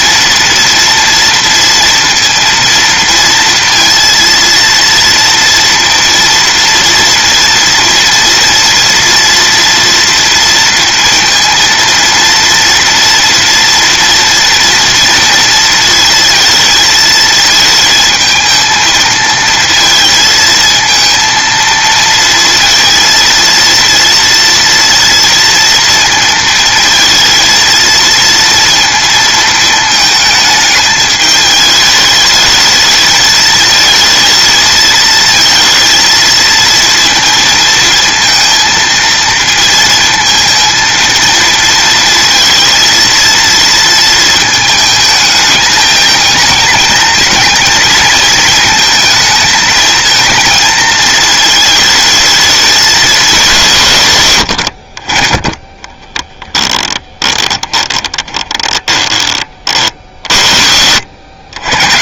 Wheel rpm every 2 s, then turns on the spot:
230, 230, 230, 240, 230, 230, 230, 230, 220, 230, 220, 230, 230, 220, 230, 220, 220, 220, 230, 230, 230, 230, 220, 220, 220, 220, 210, 70, 10, 10, 90.
56-60